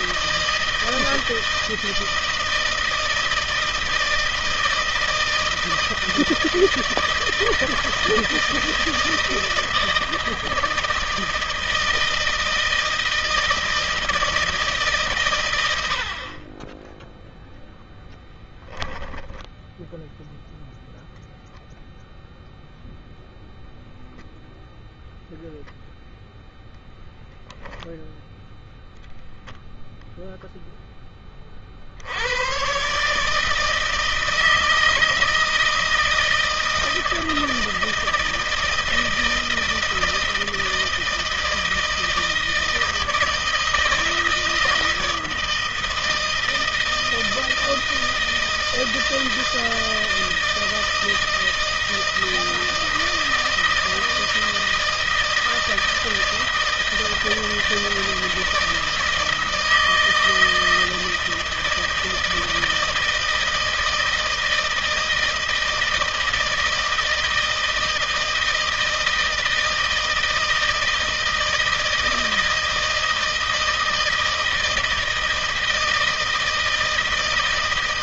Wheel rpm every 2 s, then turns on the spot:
160, 160, 160, 160, 160, 160, 160, 150, 10, 10, 0, 0, 0, 0, 0, 0, 130, 160, 160, 160, 160, 160, 160, 160, 160, 160, 160, 160, 160, 160, 160, 160, 160, 160, 160, 160, 160, 160, 160.
18-20